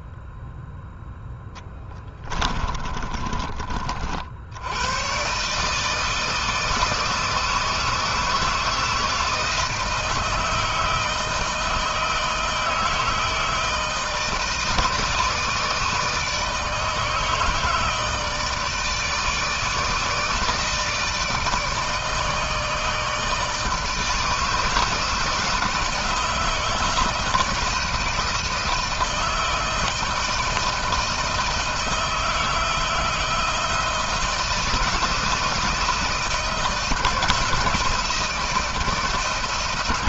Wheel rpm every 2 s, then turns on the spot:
10, 30, 100, 160, 160, 160, 160, 160, 160, 160, 160, 160, 160, 160, 160, 160, 160, 160, 160, 160.
2-4